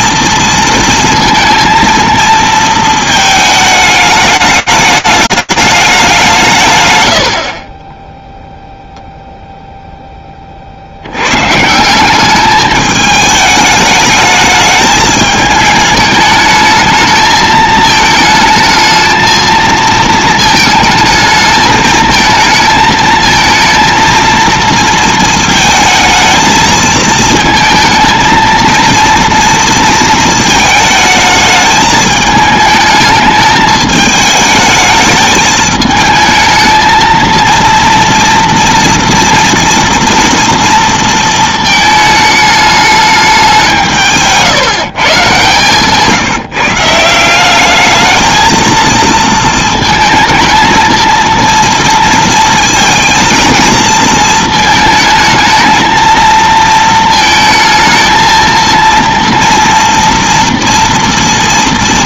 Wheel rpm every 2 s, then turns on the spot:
230, 220, 210, 100, 0, 60, 210, 210, 220, 220, 220, 220, 230, 220, 230, 220, 220, 220, 220, 230, 230, 210, 140, 160, 230, 230, 220, 220, 220, 230, 240.
none